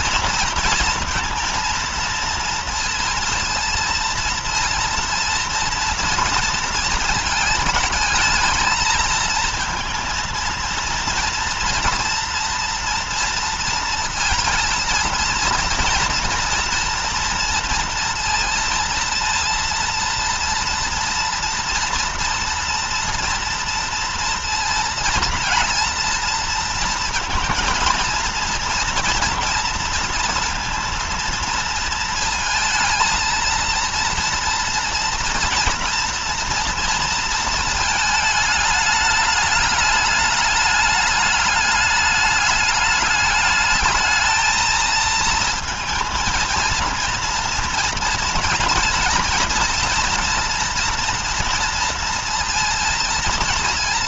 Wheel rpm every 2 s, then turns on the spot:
230, 230, 230, 230, 220, 230, 230, 230, 230, 230, 230, 230, 230, 230, 230, 230, 230, 230, 230, 210, 210, 210, 220, 220, 230, 240, 230.
none